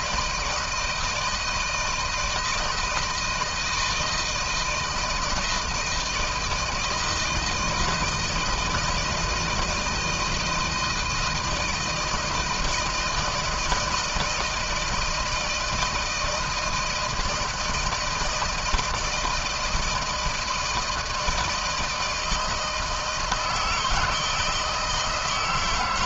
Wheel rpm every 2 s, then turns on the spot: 170, 160, 160, 160, 160, 170, 160, 160, 160, 160, 160, 160, 160.
none